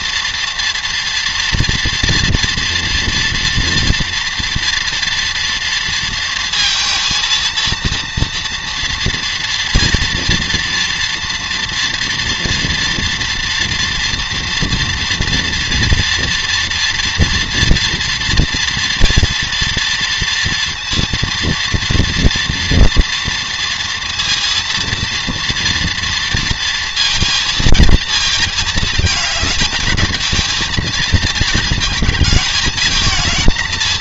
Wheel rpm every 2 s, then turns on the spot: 230, 230, 230, 230, 230, 230, 230, 230, 240, 230, 230, 230, 230, 230, 220, 220, 220.
none